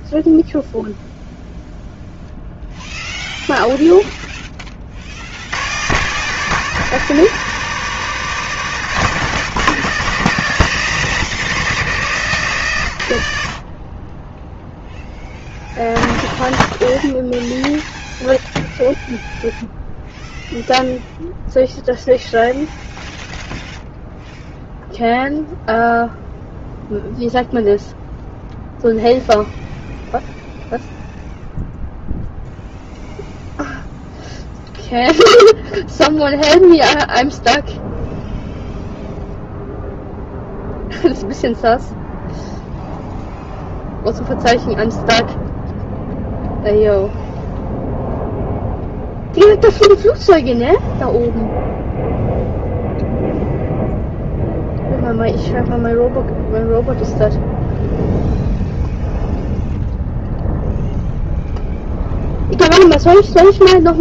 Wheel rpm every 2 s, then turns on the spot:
0, 0, 40, 180, 170, 170, 120, 0, 0, 0, 0, 0, 0, 0, 0, 0, 0, 0, 0, 0, 0, 0, 0, 0, 0, 0, 0, 0, 0, 0, 0, 0.
none